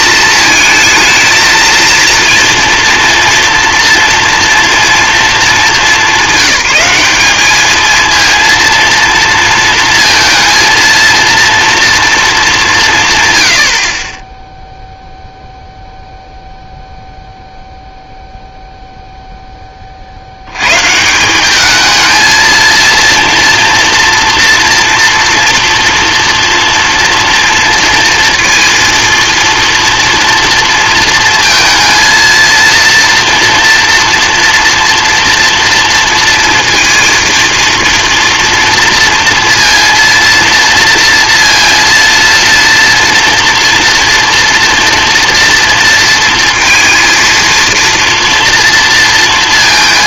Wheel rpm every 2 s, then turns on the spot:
220, 230, 220, 200, 230, 230, 140, 0, 0, 0, 110, 220, 230, 230, 230, 230, 230, 230, 230, 230, 230, 230, 230, 230, 230.
none